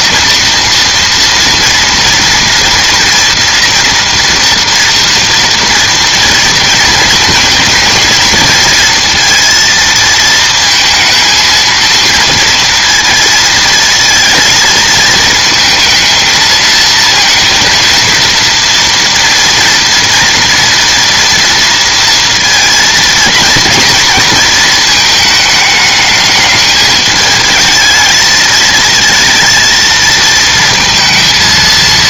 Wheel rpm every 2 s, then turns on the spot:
230, 240, 230, 230, 230, 230, 230, 230, 230, 230, 230, 230, 220, 210, 220, 220.
none